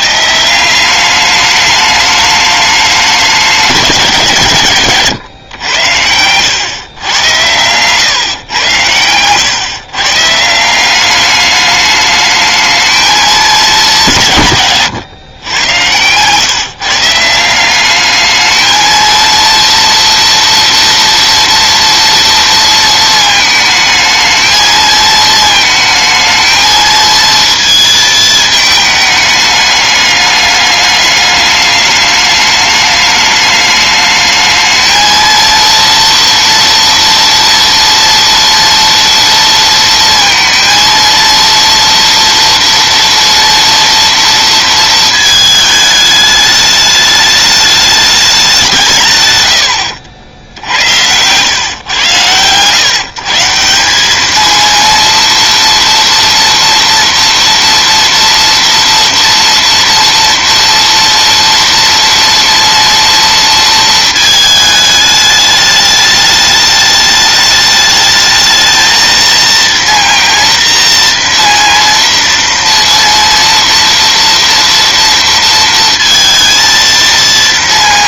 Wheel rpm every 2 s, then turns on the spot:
170, 210, 130, 120, 110, 150, 210, 150, 130, 220, 230, 230, 220, 220, 220, 210, 210, 220, 230, 230, 230, 230, 230, 210, 190, 80, 120, 220, 230, 240, 230, 230, 220, 210, 220, 230, 230, 230, 230.
none